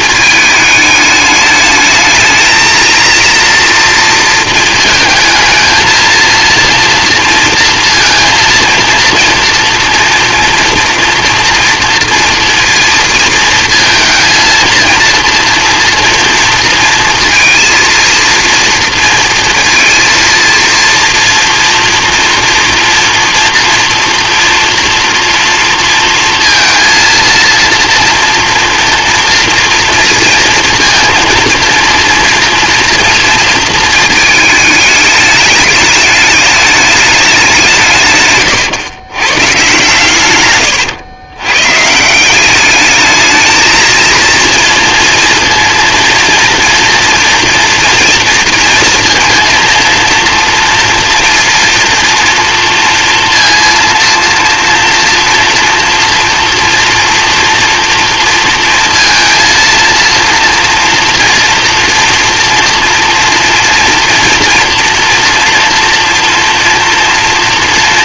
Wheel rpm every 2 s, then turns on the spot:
220, 220, 230, 230, 230, 230, 230, 230, 230, 230, 230, 230, 230, 230, 230, 230, 230, 220, 210, 120, 110, 200, 230, 230, 230, 230, 230, 230, 230, 230, 230, 230, 230, 230.
40-42